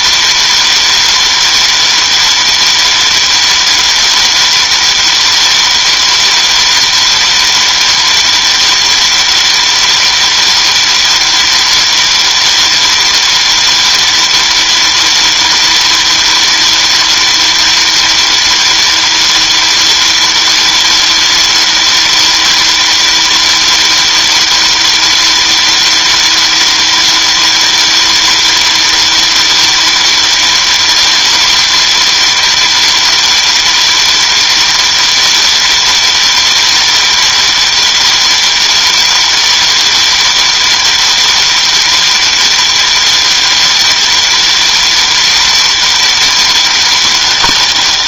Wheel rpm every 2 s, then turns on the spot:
310, 310, 310, 310, 310, 310, 310, 310, 310, 310, 310, 310, 310, 310, 310, 310, 310, 310, 310, 310, 310, 310, 310, 310.
none